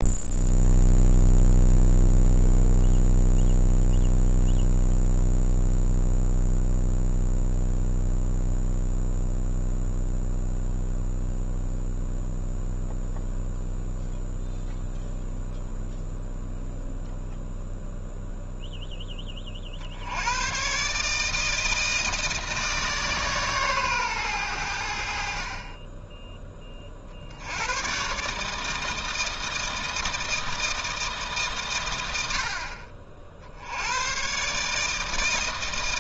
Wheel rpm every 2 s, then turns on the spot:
0, 0, 0, 0, 0, 0, 0, 0, 0, 0, 130, 150, 80, 30, 160, 160, 50, 150.
none